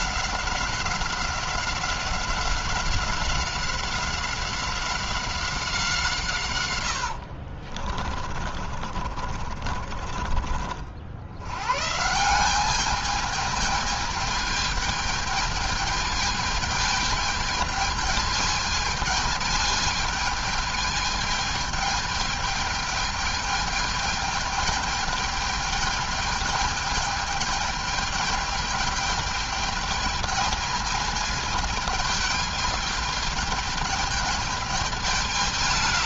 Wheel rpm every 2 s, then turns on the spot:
190, 190, 190, 130, 30, 50, 180, 210, 210, 210, 210, 220, 210, 210, 210, 220, 210, 210.
6-10